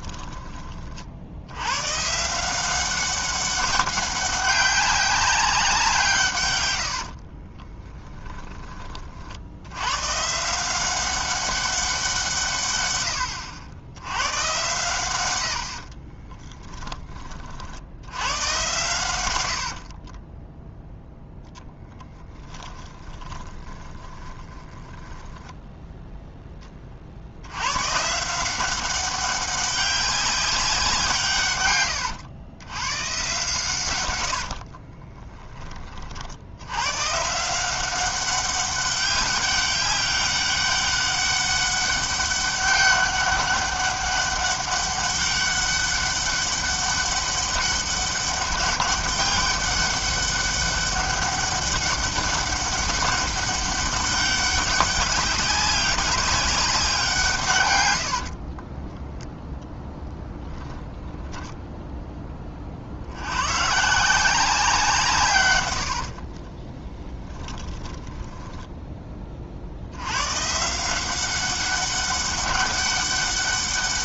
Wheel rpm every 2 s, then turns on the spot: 40, 190, 200, 90, 20, 180, 140, 110, 20, 110, 0, 10, 10, 40, 190, 180, 120, 40, 100, 200, 200, 200, 200, 200, 200, 200, 200, 200, 190, 10, 10, 50, 170, 20, 10, 170, 200.
6-8 16-18 22-26 34-36 58-62 66-68